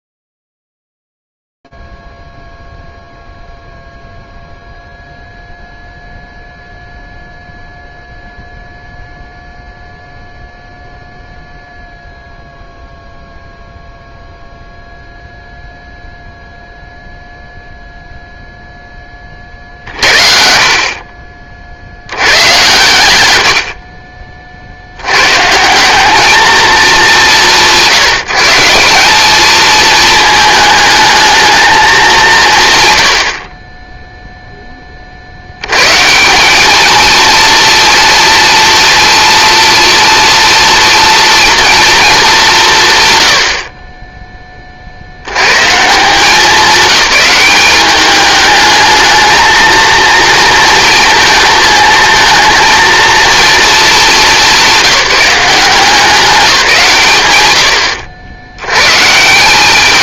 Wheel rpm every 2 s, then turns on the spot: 0, 0, 0, 0, 0, 0, 0, 0, 0, 0, 50, 100, 40, 210, 180, 220, 140, 10, 200, 230, 230, 170, 40, 190, 210, 230, 230, 190, 170, 100.
none